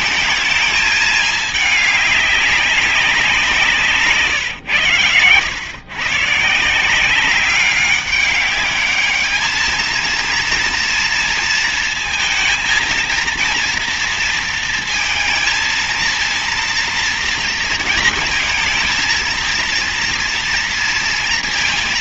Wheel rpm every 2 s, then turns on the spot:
210, 200, 130, 160, 200, 230, 230, 230, 230, 230, 230.
none